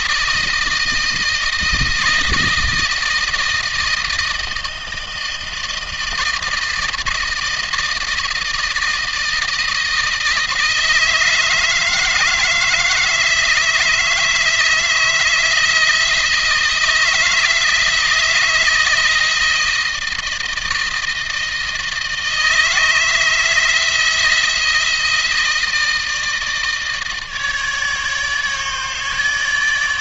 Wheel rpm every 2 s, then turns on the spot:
160, 160, 160, 160, 160, 160, 160, 160, 160, 160, 160, 160, 160, 160, 150.
none